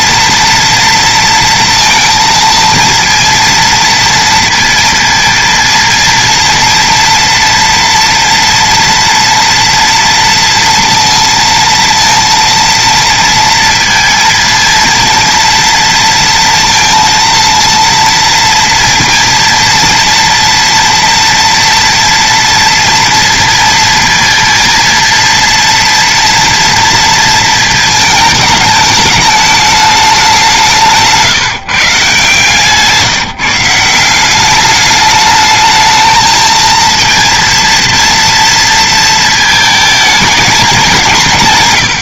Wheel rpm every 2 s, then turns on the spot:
230, 230, 230, 230, 230, 240, 230, 230, 230, 230, 240, 230, 230, 230, 220, 200, 150, 190, 220, 230, 220.
none